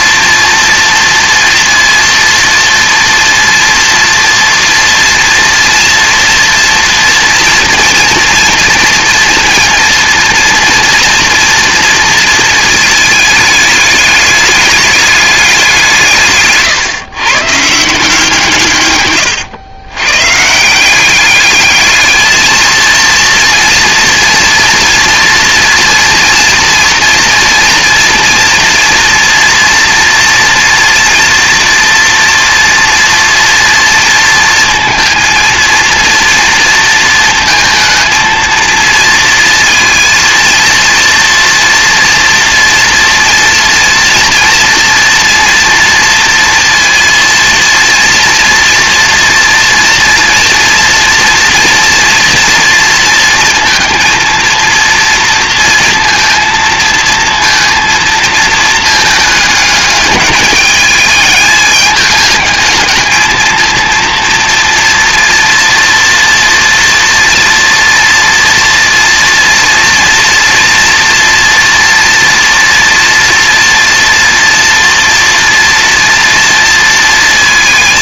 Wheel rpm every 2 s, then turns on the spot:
240, 230, 230, 230, 230, 230, 220, 210, 160, 160, 140, 220, 230, 230, 230, 230, 230, 230, 230, 230, 230, 230, 230, 230, 230, 230, 230, 230, 230, 220, 210, 220, 230, 230, 230, 230, 230, 230, 230.
none